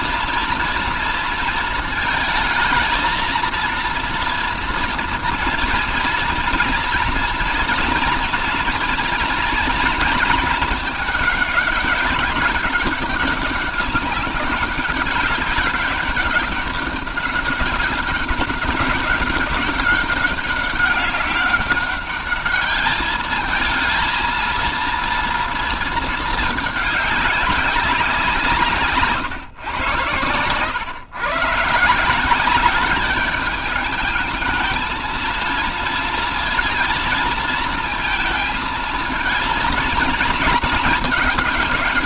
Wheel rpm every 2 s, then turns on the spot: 230, 220, 230, 230, 240, 220, 200, 200, 200, 200, 200, 210, 230, 210, 150, 110, 200, 220, 230, 230, 220.
none